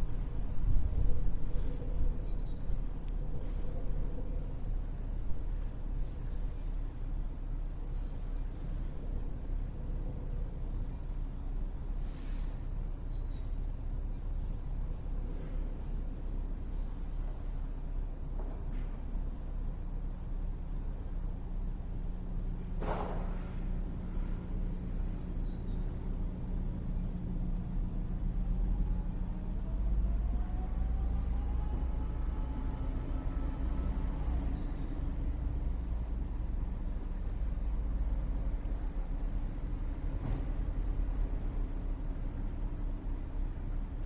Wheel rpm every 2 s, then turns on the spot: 0, 0, 0, 0, 0, 0, 0, 0, 0, 0, 0, 0, 0, 0, 0, 0, 0, 0, 0, 0, 0, 0.
none